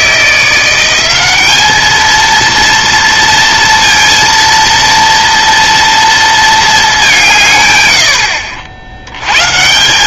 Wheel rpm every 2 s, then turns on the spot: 180, 230, 230, 220, 80.
none